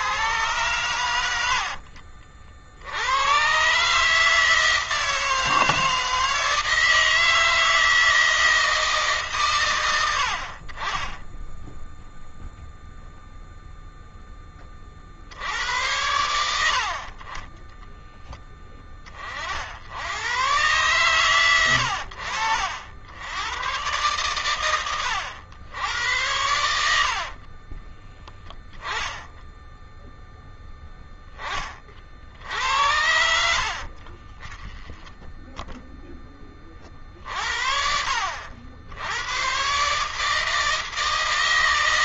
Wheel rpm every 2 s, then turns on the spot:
110, 60, 160, 160, 160, 50, 0, 10, 80, 10, 110, 70, 120, 80, 10, 0, 60, 20, 20, 60, 150.
34-36